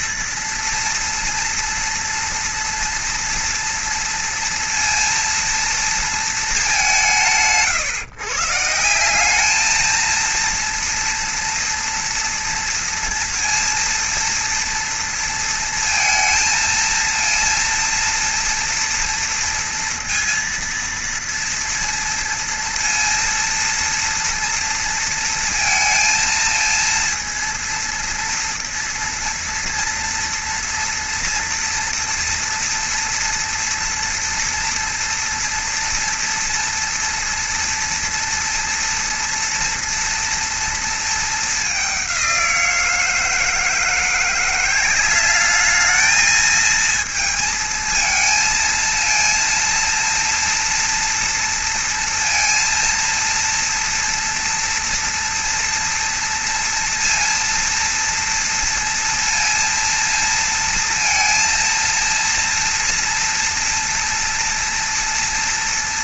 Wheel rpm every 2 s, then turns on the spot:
230, 230, 230, 160, 150, 230, 230, 230, 230, 230, 230, 230, 230, 230, 230, 230, 230, 230, 230, 230, 230, 180, 180, 220, 230, 240, 230, 240, 230, 230, 230, 230, 230.
none